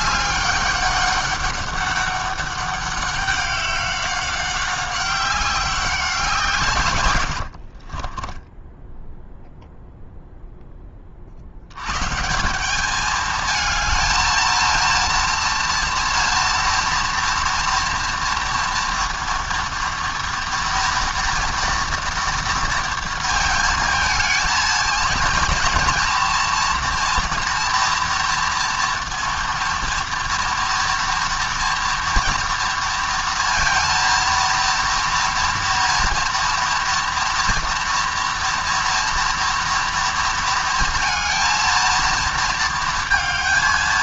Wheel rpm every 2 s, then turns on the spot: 200, 200, 190, 130, 10, 10, 200, 230, 230, 230, 230, 230, 220, 230, 240, 230, 230, 230, 230, 230, 230, 230.
8-10